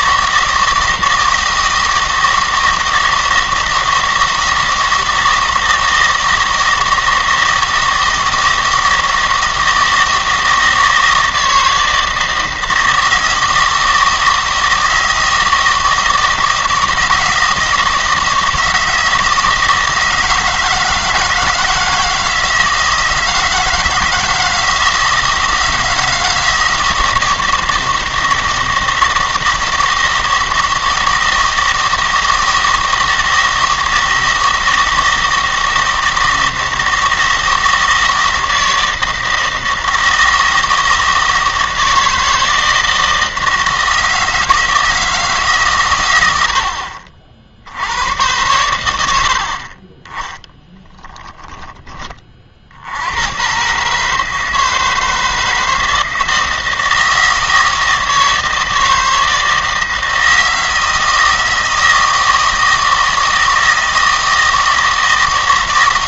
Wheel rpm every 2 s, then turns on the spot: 160, 170, 160, 160, 160, 160, 160, 160, 160, 160, 160, 160, 160, 160, 160, 160, 160, 160, 160, 160, 160, 160, 160, 60, 90, 10, 70, 160, 160, 160, 160, 160, 160.
none